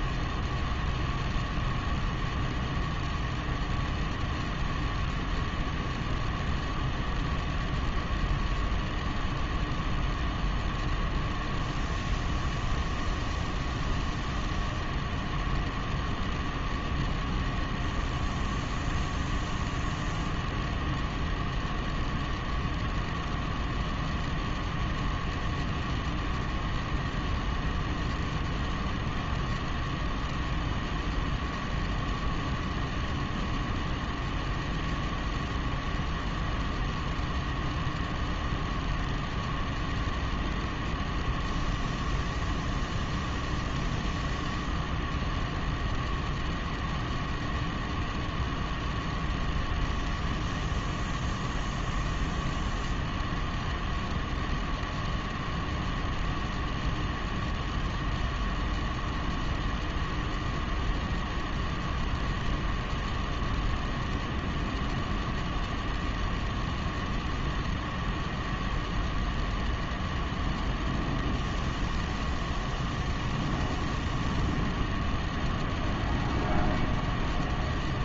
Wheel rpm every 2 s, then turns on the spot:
0, 0, 0, 0, 0, 0, 0, 0, 0, 0, 0, 0, 0, 0, 0, 0, 0, 0, 0, 0, 0, 0, 0, 0, 0, 0, 0, 0, 0, 0, 0, 0, 0, 0, 0, 0, 0, 0, 0.
none